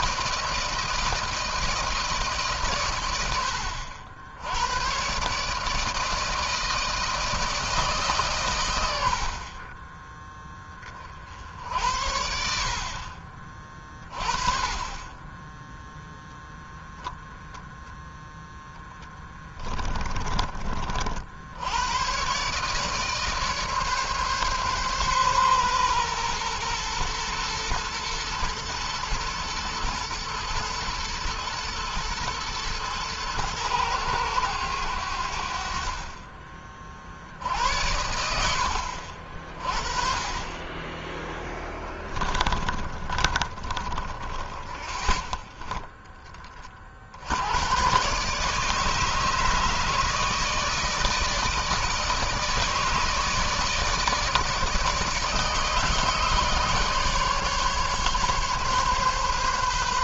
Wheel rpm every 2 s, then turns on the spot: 160, 120, 120, 160, 90, 30, 50, 30, 0, 10, 50, 140, 140, 120, 110, 120, 110, 90, 40, 70, 20, 30, 20, 40, 150, 160, 150, 150, 150, 140.
18-20 42-44